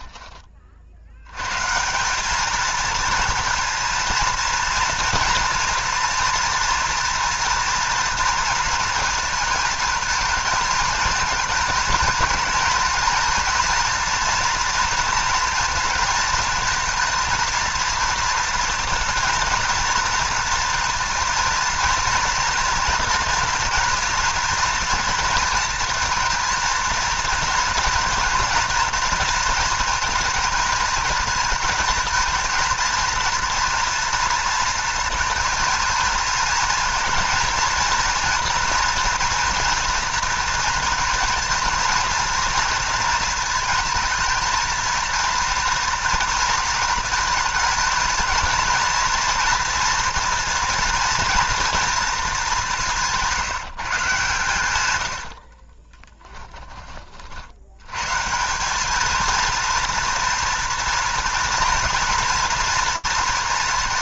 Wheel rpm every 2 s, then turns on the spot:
50, 230, 230, 230, 220, 220, 230, 230, 220, 230, 230, 230, 230, 230, 230, 220, 230, 230, 230, 240, 230, 230, 220, 230, 230, 230, 180, 120, 20, 190, 230, 230.
none